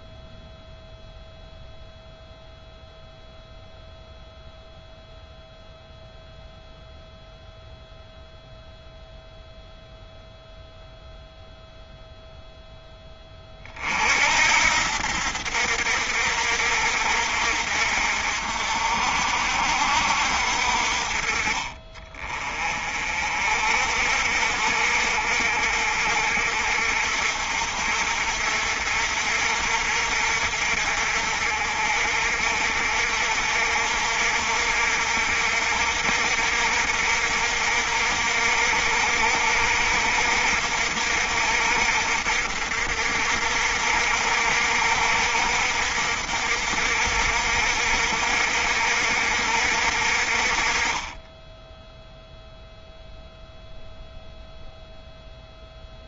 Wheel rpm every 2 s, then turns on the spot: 0, 0, 0, 0, 0, 0, 10, 70, 60, 60, 50, 40, 60, 60, 60, 60, 60, 60, 60, 60, 60, 60, 60, 60, 60, 30, 0, 0.
none